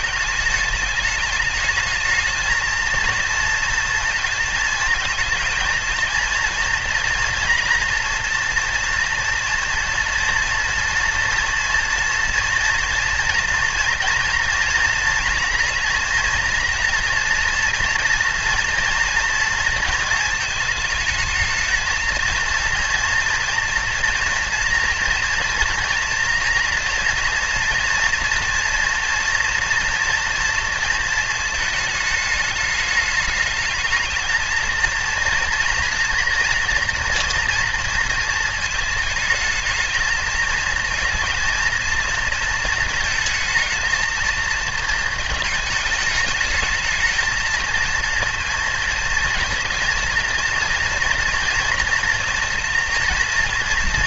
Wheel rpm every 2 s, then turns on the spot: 220, 220, 220, 230, 230, 230, 230, 230, 230, 230, 220, 230, 230, 230, 230, 230, 210, 220, 240, 230, 230, 220, 220, 220, 230, 230, 230.
none